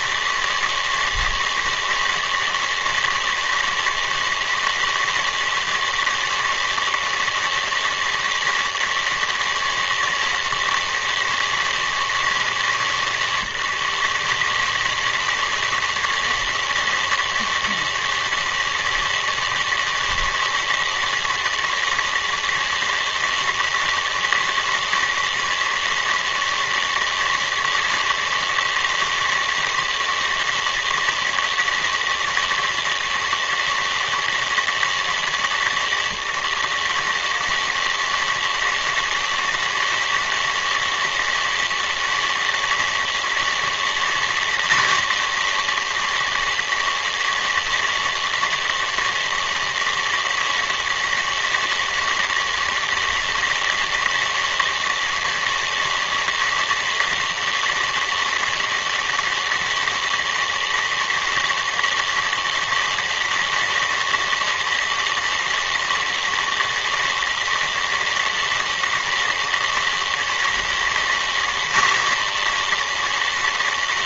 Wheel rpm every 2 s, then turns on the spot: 160, 160, 160, 160, 160, 160, 160, 150, 160, 160, 160, 160, 160, 160, 160, 160, 160, 160, 150, 160, 160, 160, 180, 160, 160, 160, 160, 160, 160, 160, 160, 160, 160, 160, 160, 180, 160.
none